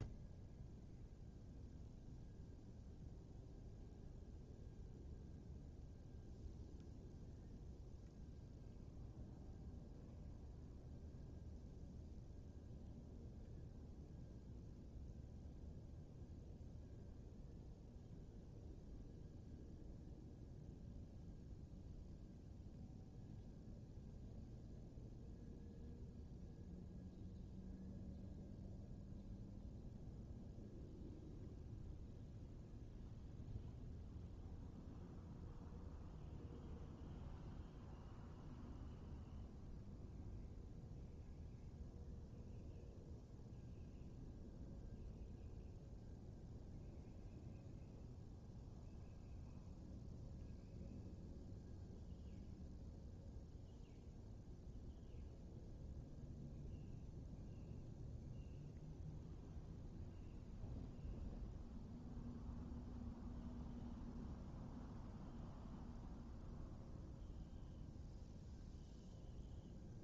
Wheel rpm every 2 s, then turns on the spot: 0, 0, 0, 0, 0, 0, 0, 0, 0, 0, 0, 0, 0, 0, 0, 0, 0, 0, 0, 0, 0, 0, 0, 0, 0, 0, 0, 0, 0, 0, 0, 0, 0, 0, 0.
none